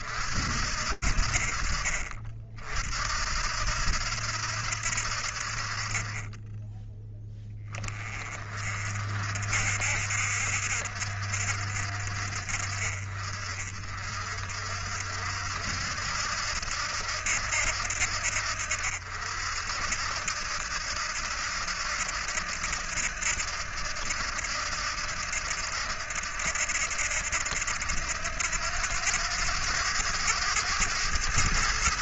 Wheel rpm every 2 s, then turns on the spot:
40, 80, 20, 30, 60, 50, 50, 70, 70, 70, 80, 80, 80, 80, 100, 110.
none